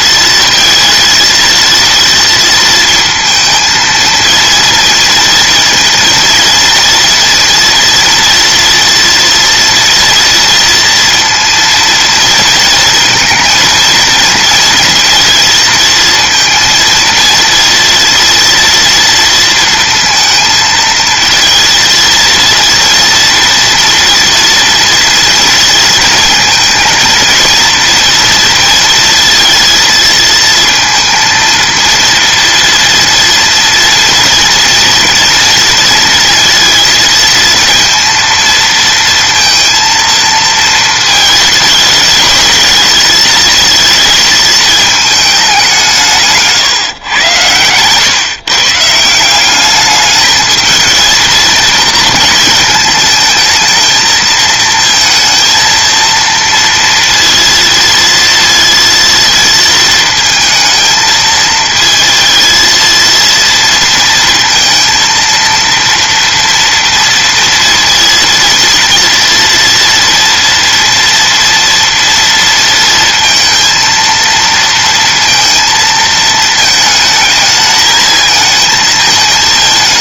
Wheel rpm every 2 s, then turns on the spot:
230, 230, 230, 230, 230, 230, 230, 230, 230, 230, 230, 230, 230, 230, 230, 230, 230, 230, 230, 230, 220, 220, 220, 130, 160, 220, 220, 230, 230, 230, 220, 230, 230, 230, 230, 230, 230, 230, 220, 220.
none